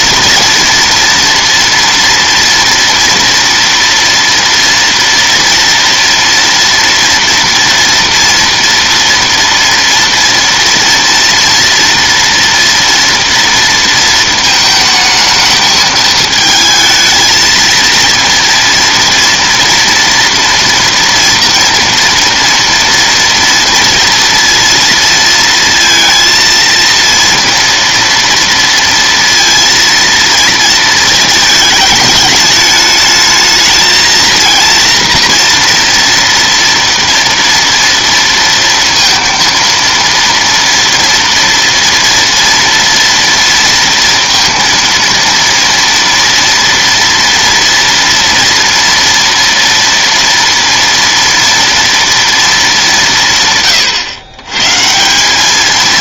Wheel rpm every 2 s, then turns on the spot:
230, 240, 230, 230, 230, 230, 230, 220, 220, 230, 230, 230, 230, 230, 230, 220, 220, 230, 230, 230, 230, 230, 230, 230, 230, 230, 200, 150.
none